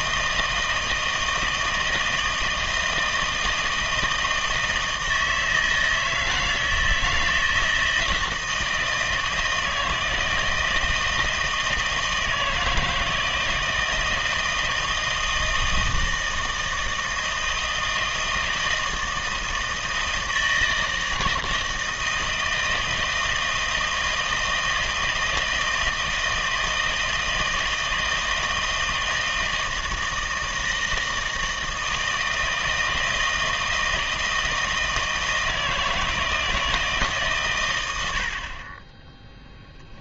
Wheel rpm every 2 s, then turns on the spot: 160, 160, 160, 160, 160, 160, 160, 160, 160, 160, 160, 160, 160, 160, 160, 160, 160, 160, 160, 30.
none